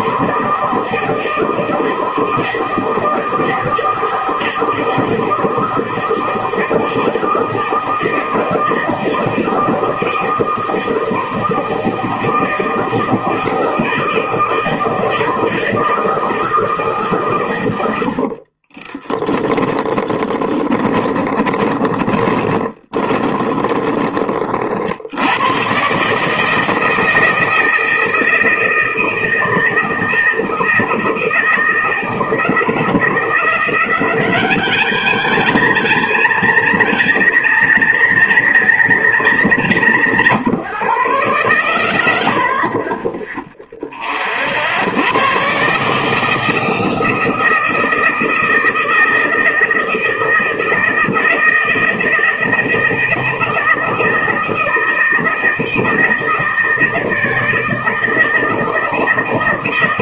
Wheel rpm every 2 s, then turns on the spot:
160, 160, 160, 160, 160, 160, 160, 160, 160, 50, 20, 20, 40, 160, 160, 160, 40, 0, 0, 0, 0, 10, 50, 160, 160, 160, 160, 160, 160, 160.
18-24 42-44